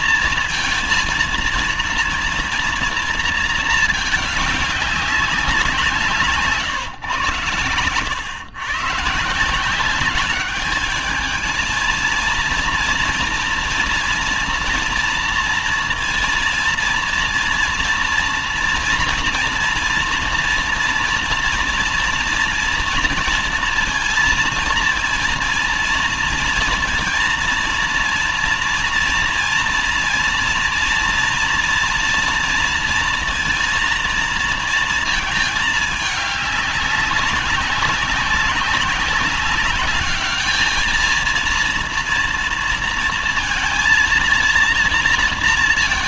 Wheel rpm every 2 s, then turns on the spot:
230, 230, 210, 150, 110, 210, 230, 230, 230, 230, 230, 230, 230, 230, 230, 230, 230, 230, 200, 190, 220, 230, 240.
none